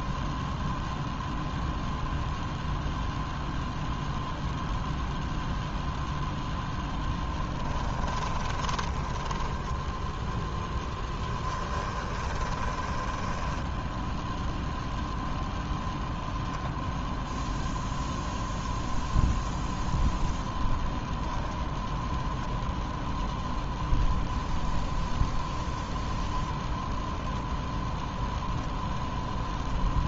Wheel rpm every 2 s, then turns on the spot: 0, 0, 0, 10, 10, 10, 10, 0, 0, 0, 0, 0, 0, 0, 0.
8-14